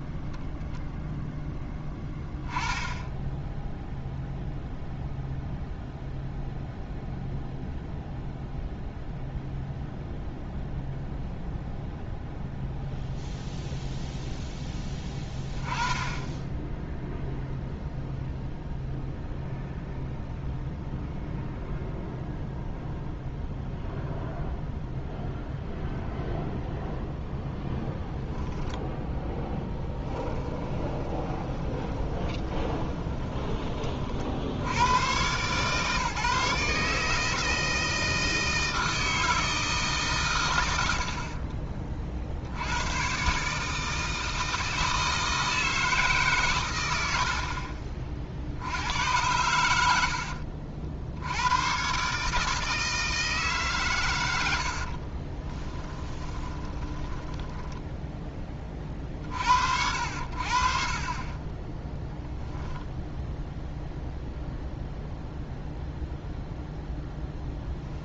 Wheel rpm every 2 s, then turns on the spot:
0, 10, 0, 0, 0, 0, 0, 10, 0, 0, 0, 0, 0, 0, 0, 20, 20, 110, 150, 160, 80, 120, 160, 100, 80, 70, 160, 70, 20, 30, 50, 0, 0, 0.
30-34 54-58